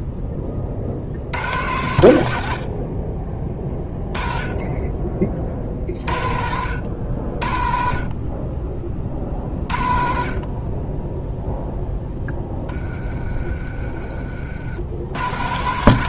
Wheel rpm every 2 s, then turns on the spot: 40, 60, 20, 70, 30, 30, 20, 70.
none